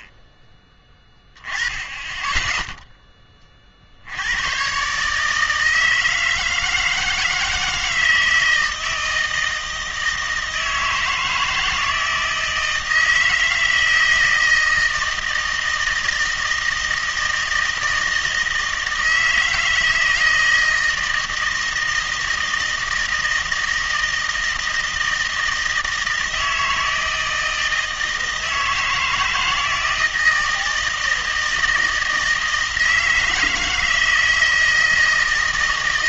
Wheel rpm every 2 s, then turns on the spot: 20, 10, 110, 160, 160, 160, 160, 160, 160, 160, 160, 160, 160, 160, 160, 160, 160, 160.
none